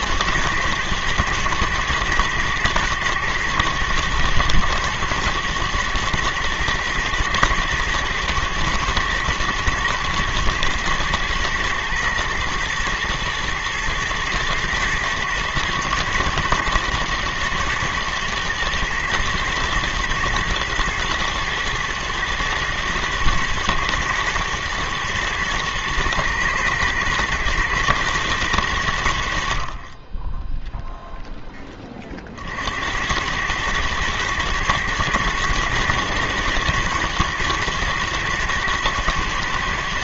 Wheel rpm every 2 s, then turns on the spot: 110, 110, 110, 110, 110, 110, 110, 110, 110, 120, 110, 120, 120, 120, 110, 0, 50, 110, 120, 120.
none